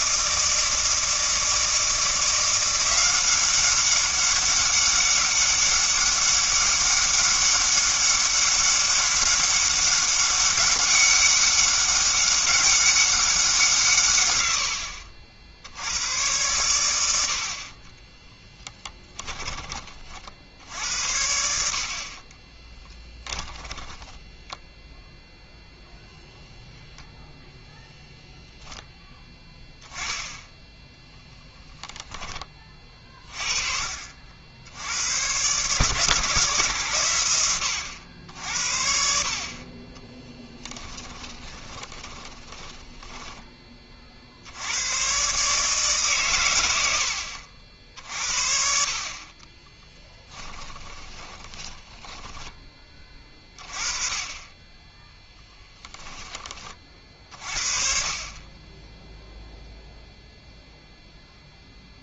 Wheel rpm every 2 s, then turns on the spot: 160, 180, 200, 200, 200, 200, 200, 90, 100, 10, 70, 10, 0, 0, 0, 10, 30, 80, 140, 70, 10, 10, 90, 100, 50, 10, 20, 20, 30, 20, 0.
18-20 22-24 42-44 50-52